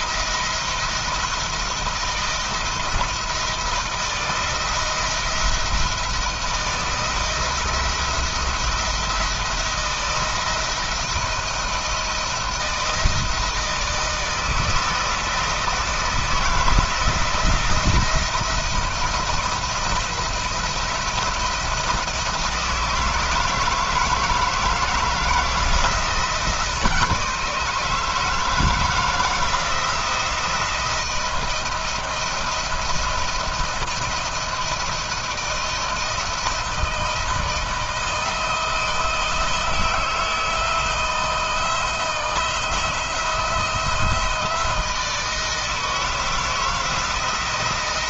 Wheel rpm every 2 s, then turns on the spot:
170, 170, 170, 170, 170, 160, 160, 160, 170, 170, 170, 160, 160, 160, 160, 170, 170, 170, 160, 160, 160, 170, 160, 170.
none